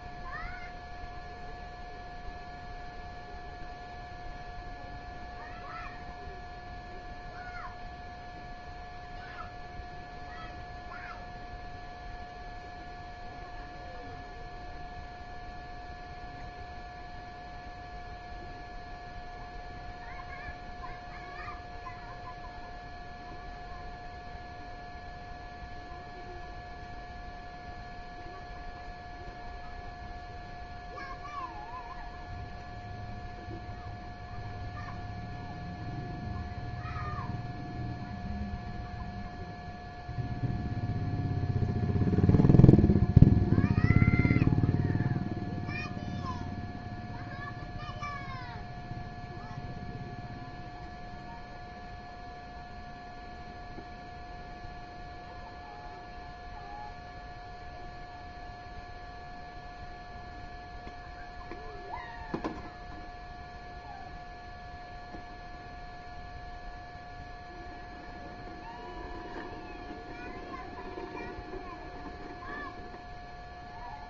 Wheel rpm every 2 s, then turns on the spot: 0, 0, 0, 0, 0, 0, 0, 0, 0, 0, 0, 0, 0, 0, 0, 0, 0, 0, 0, 0, 0, 0, 0, 0, 0, 0, 0, 0, 0, 0, 0, 0, 0, 0, 0, 0, 0.
none